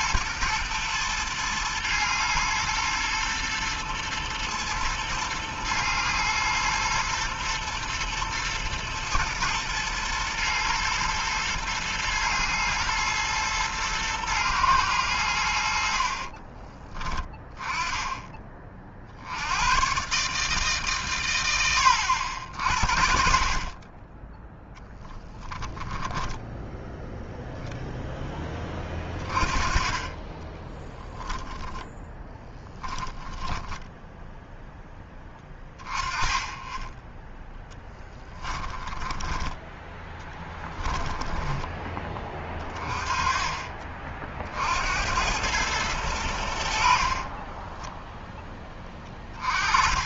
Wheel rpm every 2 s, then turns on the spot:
110, 120, 110, 110, 110, 110, 120, 100, 20, 60, 120, 50, 10, 0, 20, 10, 10, 10, 10, 10, 10, 30, 90, 50, 20.
32-34 38-42 46-48